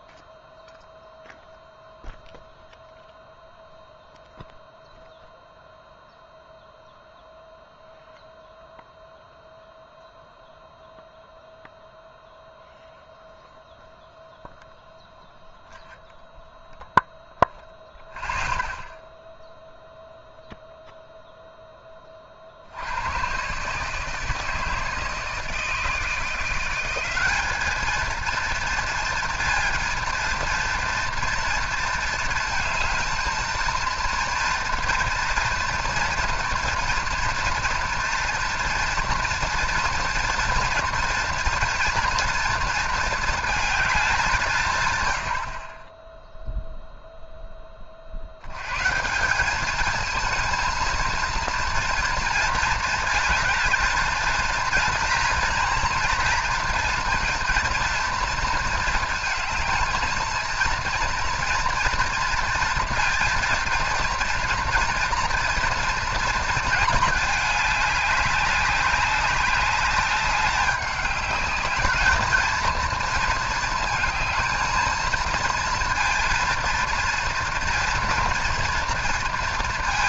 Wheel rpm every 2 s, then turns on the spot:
0, 0, 0, 0, 0, 0, 0, 0, 0, 0, 0, 70, 160, 170, 230, 230, 220, 230, 230, 240, 230, 230, 140, 0, 90, 230, 230, 230, 230, 230, 230, 230, 240, 220, 200, 200, 230, 220, 230, 230.
none